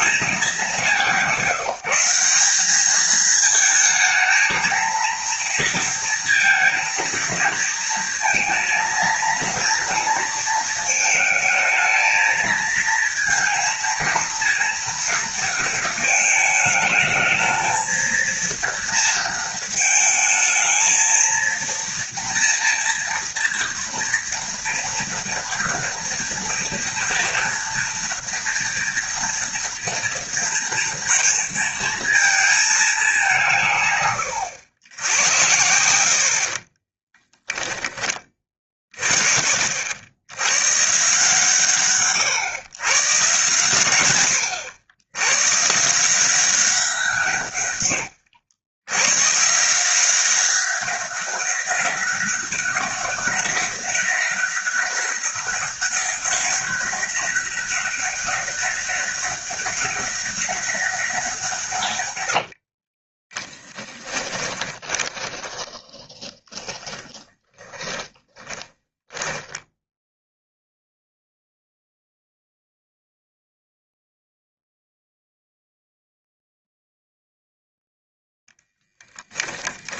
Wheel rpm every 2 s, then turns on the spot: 200, 210, 230, 230, 230, 220, 230, 230, 220, 230, 230, 230, 230, 230, 230, 230, 200, 90, 20, 30, 140, 130, 100, 170, 100, 200, 200, 200, 200, 200, 190, 30, 20, 10, 10, 0, 0, 0, 0, 10.
36-38 62-70